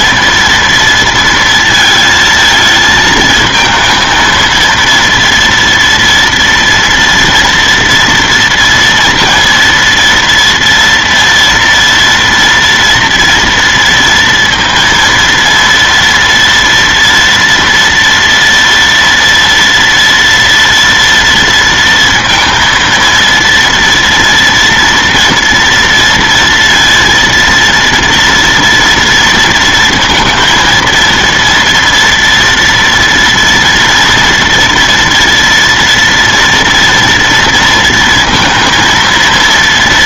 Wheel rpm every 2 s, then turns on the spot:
230, 230, 230, 230, 230, 230, 240, 230, 230, 240, 230, 230, 230, 230, 230, 230, 230, 230, 230, 230.
none